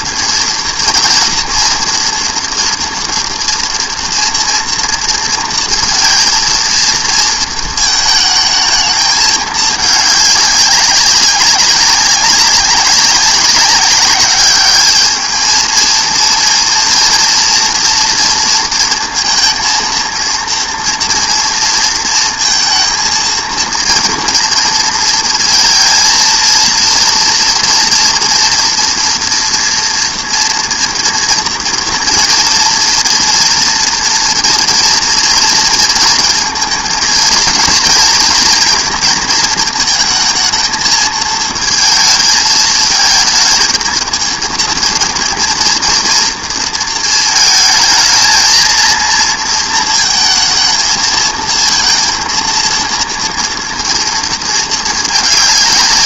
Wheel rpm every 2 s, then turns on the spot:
230, 230, 230, 230, 220, 200, 190, 210, 230, 230, 230, 220, 230, 230, 240, 230, 230, 240, 230, 230, 220, 220, 230, 230, 230, 220, 230, 220.
none